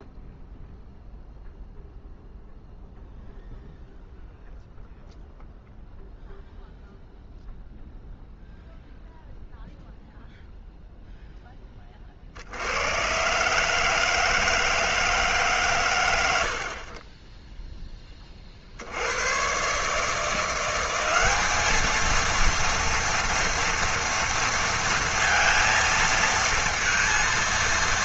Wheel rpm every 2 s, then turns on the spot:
0, 0, 0, 0, 0, 0, 70, 160, 70, 50, 180, 230, 230, 230.
none